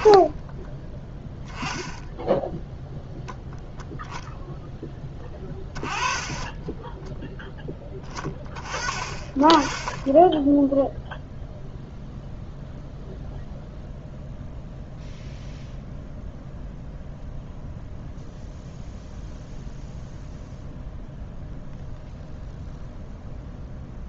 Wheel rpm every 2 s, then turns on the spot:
10, 0, 0, 10, 30, 10, 0, 0, 0, 0, 0, 0.
none